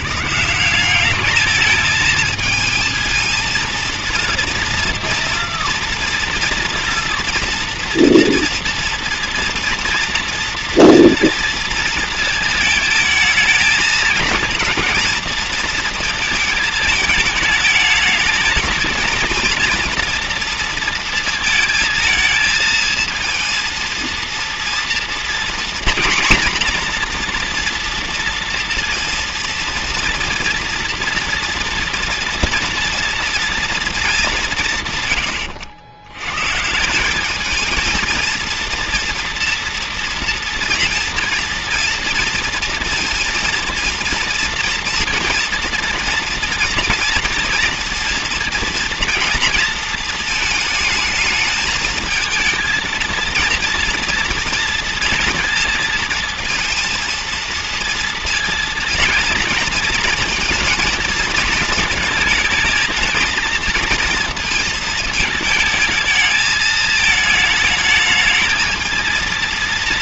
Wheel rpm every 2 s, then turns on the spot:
180, 220, 230, 230, 230, 230, 230, 220, 220, 220, 230, 220, 230, 240, 230, 230, 230, 180, 130, 230, 230, 230, 230, 230, 230, 220, 220, 230, 230, 230, 230, 220, 230, 220, 220.
none